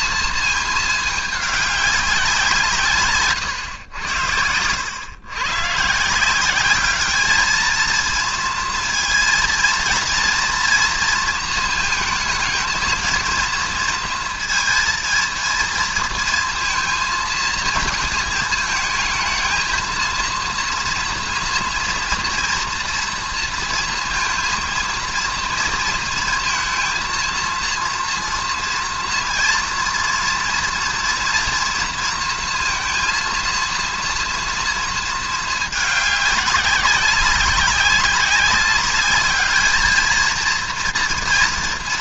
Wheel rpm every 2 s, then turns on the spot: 220, 160, 100, 200, 230, 230, 220, 230, 230, 220, 230, 240, 230, 230, 230, 230, 230, 230, 190, 200, 230.
none